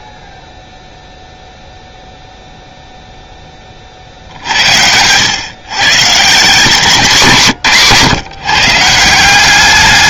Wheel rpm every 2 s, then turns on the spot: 0, 0, 70, 170, 150.
none